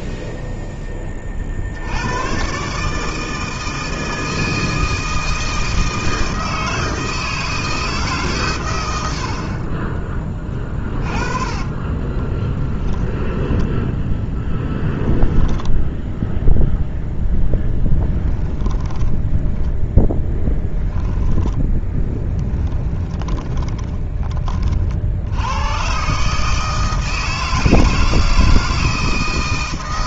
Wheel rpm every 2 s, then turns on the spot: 10, 140, 160, 160, 100, 30, 20, 10, 0, 10, 10, 20, 50, 160, 160.
10-16 18-24